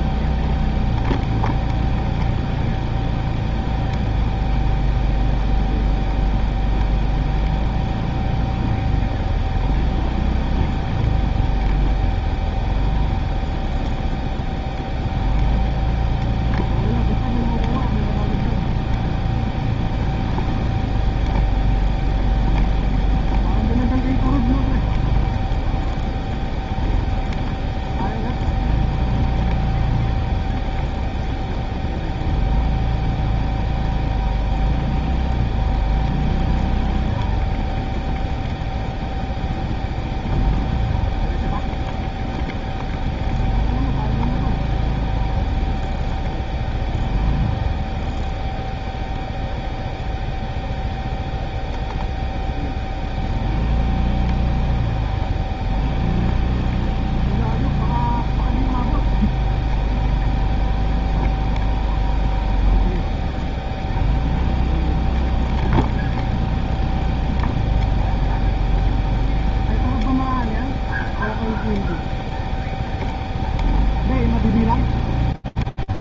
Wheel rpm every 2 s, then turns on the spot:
0, 0, 0, 0, 0, 0, 0, 0, 0, 0, 0, 0, 0, 0, 0, 0, 0, 0, 0, 0, 0, 0, 0, 0, 0, 0, 0, 0, 0, 0, 0, 0, 0, 0, 0, 0, 0, 0.
none